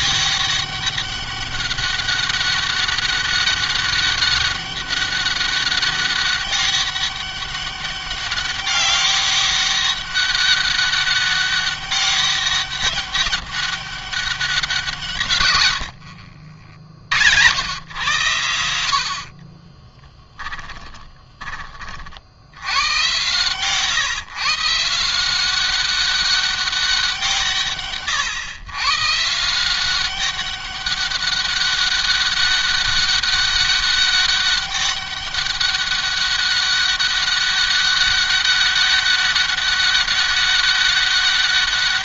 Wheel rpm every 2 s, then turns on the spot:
200, 200, 200, 200, 200, 200, 200, 180, 60, 100, 10, 90, 150, 190, 120, 190, 200, 200, 200, 200, 200.
20-22